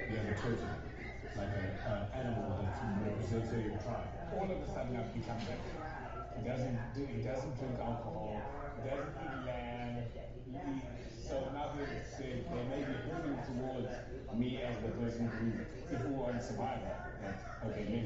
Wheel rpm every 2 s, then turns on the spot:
0, 0, 0, 0, 0, 0, 0, 0, 0.
none